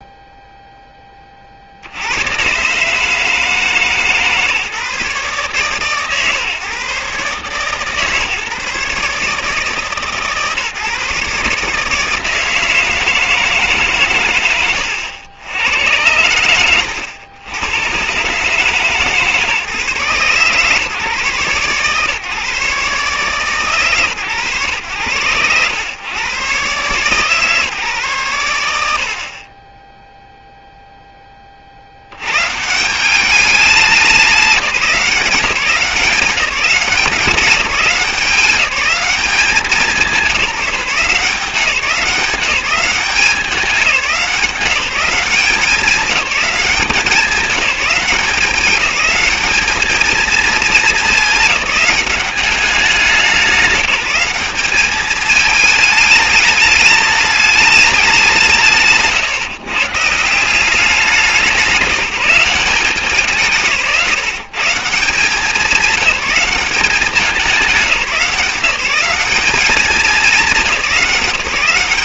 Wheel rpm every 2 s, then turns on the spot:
0, 130, 150, 140, 150, 150, 160, 100, 90, 140, 140, 140, 110, 120, 100, 0, 150, 190, 190, 190, 180, 190, 190, 190, 190, 220, 190, 200, 210, 160, 180, 190, 160, 190, 190, 200.
14-16